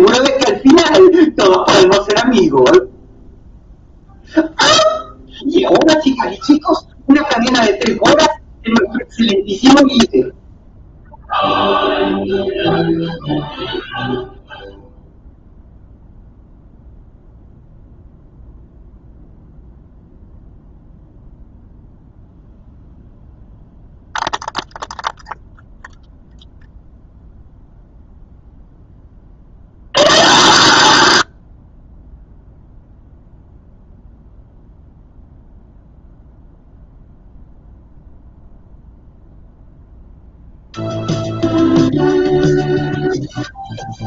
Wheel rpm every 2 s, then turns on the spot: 0, 0, 0, 0, 0, 0, 0, 0, 0, 0, 0, 0, 0, 0, 0, 0, 0, 0, 0, 0, 0, 0.
none